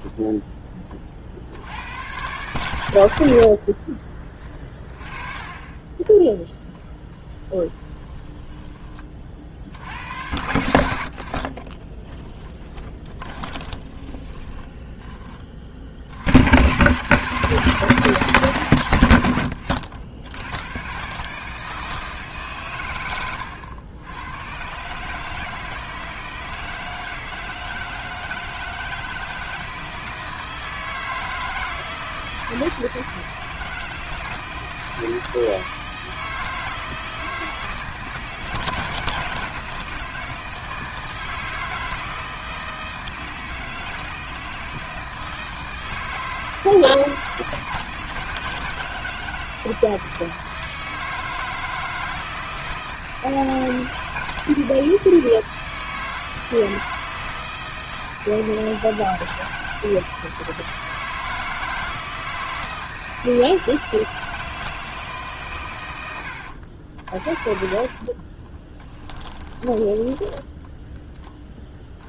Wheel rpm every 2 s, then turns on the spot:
20, 100, 20, 10, 20, 70, 20, 20, 110, 130, 100, 130, 120, 160, 160, 160, 160, 160, 160, 160, 160, 160, 160, 160, 160, 160, 160, 160, 160, 160, 160, 160, 160, 70, 20, 10.
8-10 12-16 66-72